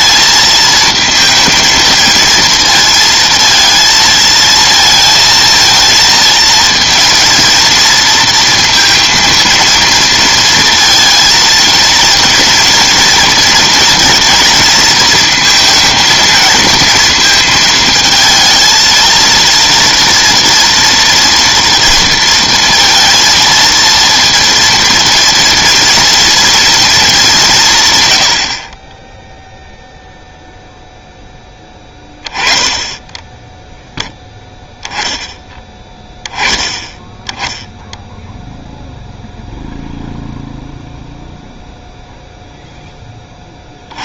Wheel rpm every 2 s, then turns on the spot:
220, 230, 220, 230, 230, 230, 230, 220, 220, 230, 230, 230, 230, 230, 50, 0, 10, 10, 20, 0, 0, 0.
none